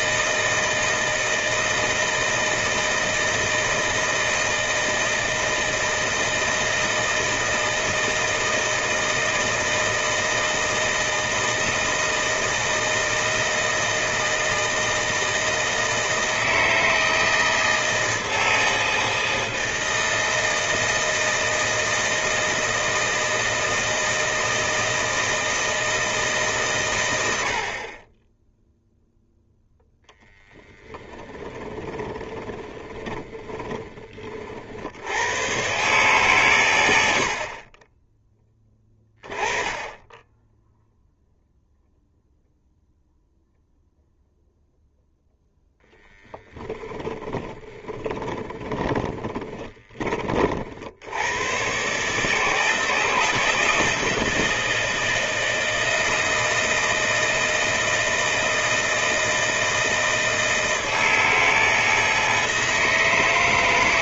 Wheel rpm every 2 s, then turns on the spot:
160, 160, 160, 160, 160, 160, 160, 160, 160, 160, 160, 160, 160, 110, 0, 10, 20, 80, 90, 10, 0, 0, 0, 10, 20, 80, 160, 160, 160, 160, 160, 160.
32-34 46-50